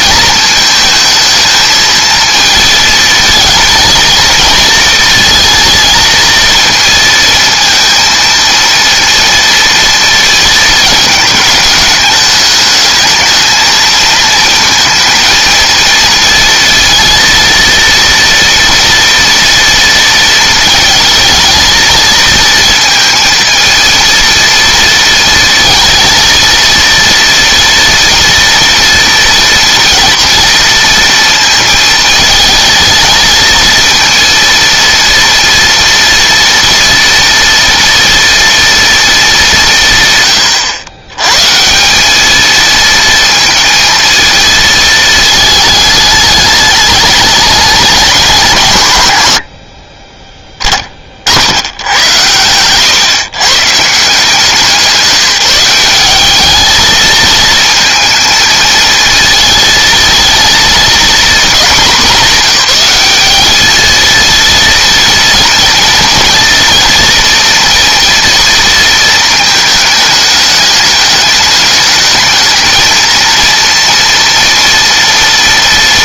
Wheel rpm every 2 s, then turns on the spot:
220, 220, 230, 230, 230, 220, 210, 230, 230, 230, 230, 230, 230, 230, 230, 230, 220, 230, 240, 230, 90, 220, 220, 210, 130, 30, 120, 180, 220, 220, 230, 200, 230, 230, 230, 210, 220, 240.
none